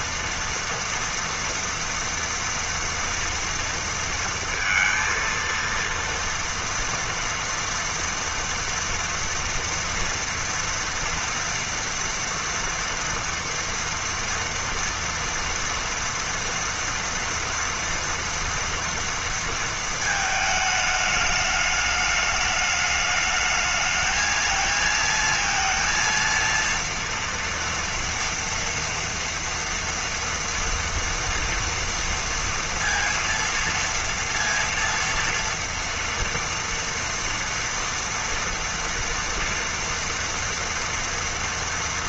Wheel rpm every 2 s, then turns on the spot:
230, 230, 230, 240, 230, 230, 230, 230, 230, 240, 220, 210, 220, 230, 230, 230, 230, 230, 230, 240, 240.
none